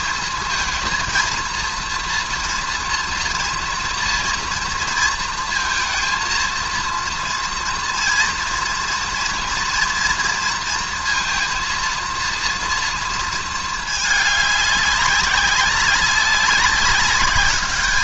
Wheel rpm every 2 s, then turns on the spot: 220, 230, 230, 230, 230, 230, 230, 200, 190.
none